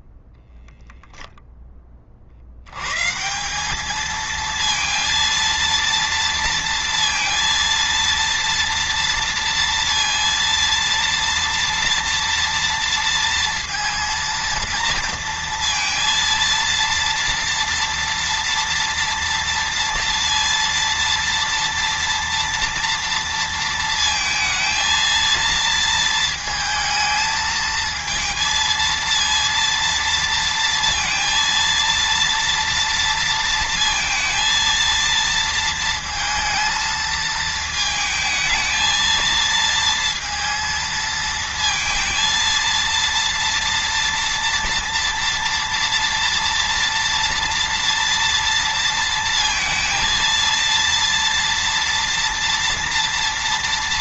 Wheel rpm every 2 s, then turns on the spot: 0, 110, 230, 230, 230, 230, 230, 230, 230, 230, 230, 230, 220, 220, 230, 230, 230, 230, 230, 220, 230, 230, 230, 230, 230, 230, 230.
none